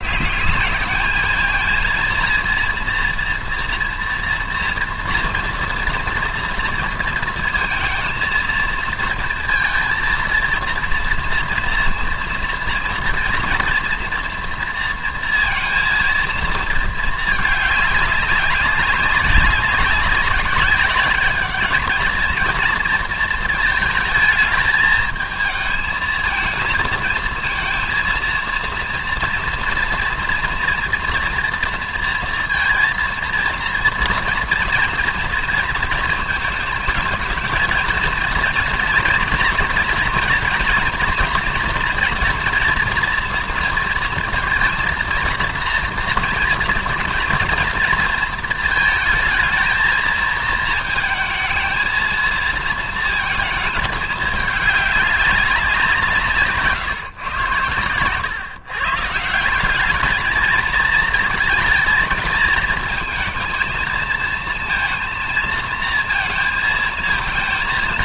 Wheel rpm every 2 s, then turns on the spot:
220, 230, 230, 230, 230, 230, 230, 230, 220, 190, 200, 230, 220, 220, 240, 240, 230, 230, 220, 230, 240, 230, 230, 230, 220, 220, 220, 200, 130, 150, 230, 220, 230, 230.
none